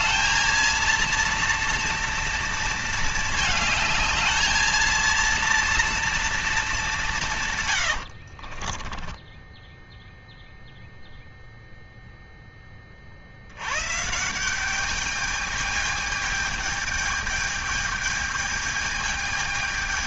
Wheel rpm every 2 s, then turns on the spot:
230, 230, 230, 200, 20, 0, 30, 200, 210, 220.
8-10